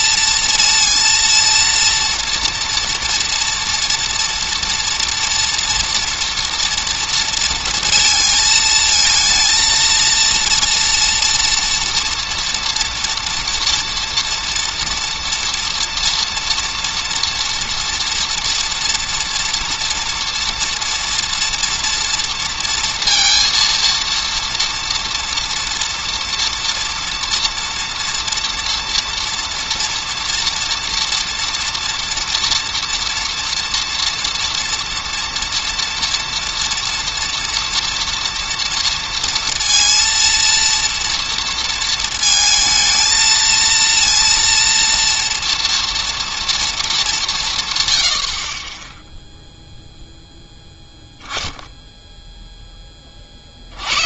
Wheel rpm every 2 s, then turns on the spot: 230, 230, 230, 240, 220, 230, 230, 240, 230, 230, 230, 230, 230, 230, 230, 230, 230, 230, 230, 230, 230, 220, 230, 230, 40, 0, 10.
none